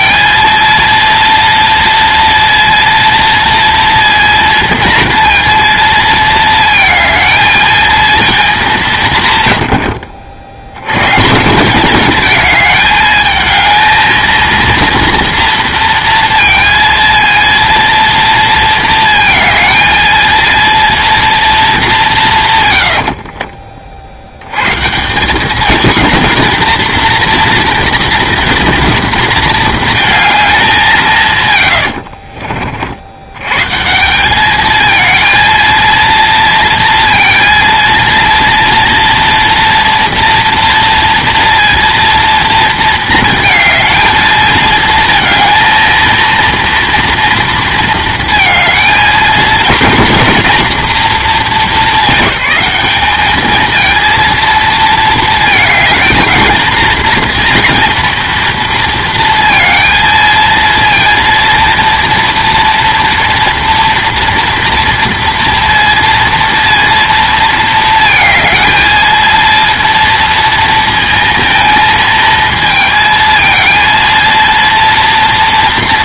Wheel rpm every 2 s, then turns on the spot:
230, 230, 230, 220, 200, 80, 220, 230, 230, 230, 230, 120, 110, 230, 230, 200, 50, 210, 230, 230, 230, 230, 220, 230, 220, 230, 190, 230, 220, 230, 230, 230, 230, 230, 220, 230, 220, 230.
none